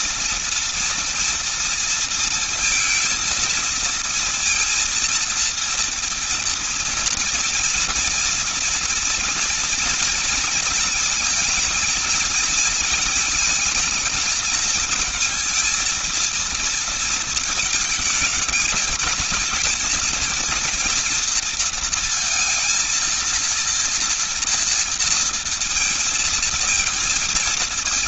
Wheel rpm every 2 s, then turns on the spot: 230, 230, 230, 230, 230, 230, 230, 220, 230, 210, 230, 230, 230, 230.
none